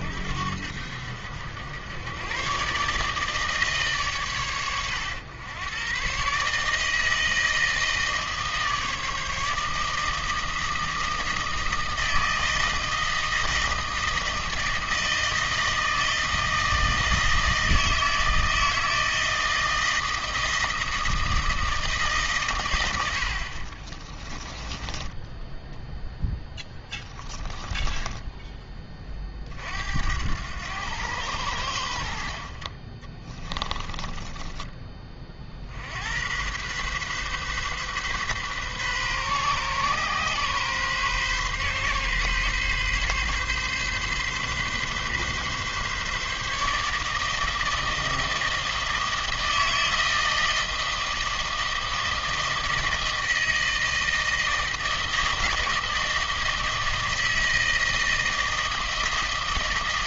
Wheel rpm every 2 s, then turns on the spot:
70, 130, 100, 150, 160, 160, 160, 160, 160, 160, 160, 120, 20, 10, 20, 90, 40, 20, 120, 130, 130, 130, 130, 150, 160, 160, 160, 160, 160, 160.
24-28